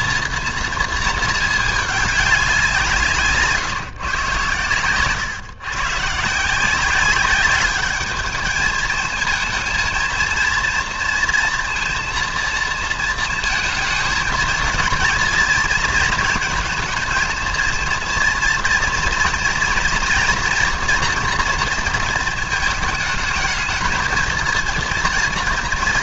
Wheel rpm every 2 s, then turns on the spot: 230, 190, 130, 170, 210, 230, 230, 230, 220, 230, 230, 220, 230.
none